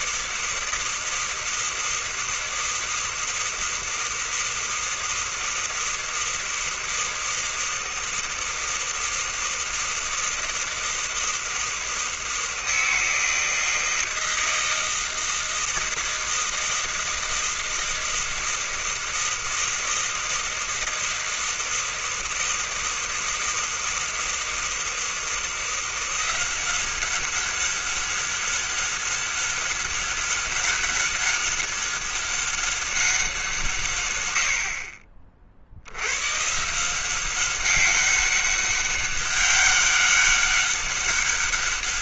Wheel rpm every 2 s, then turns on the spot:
160, 160, 160, 160, 160, 160, 160, 160, 160, 160, 160, 160, 160, 190, 200, 190, 200, 50, 170, 200, 200.
none